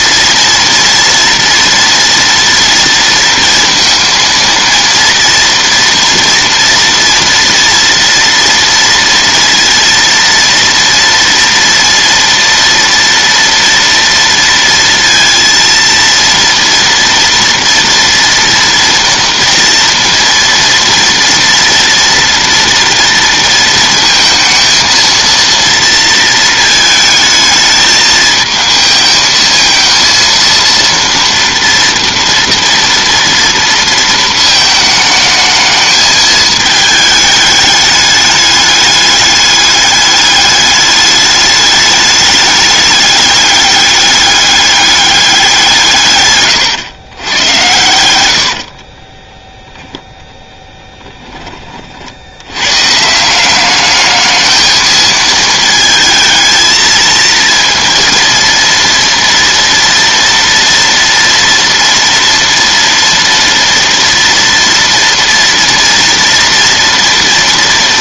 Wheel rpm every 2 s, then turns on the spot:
230, 230, 230, 230, 230, 230, 230, 230, 240, 230, 240, 230, 230, 220, 220, 230, 230, 220, 220, 210, 210, 210, 200, 100, 40, 10, 120, 220, 220, 230, 230, 230, 230, 230.
48-50